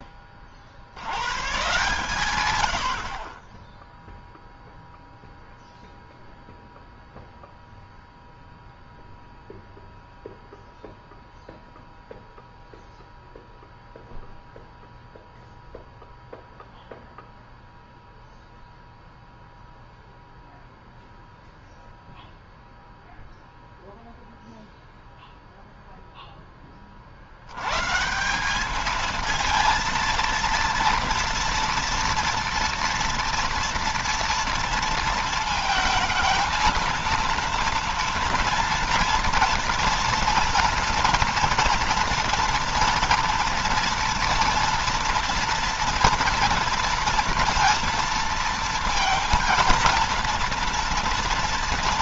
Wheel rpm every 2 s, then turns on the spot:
80, 80, 0, 0, 0, 0, 0, 0, 0, 0, 0, 0, 0, 30, 210, 230, 230, 230, 230, 230, 230, 230, 240, 230, 230, 230.
none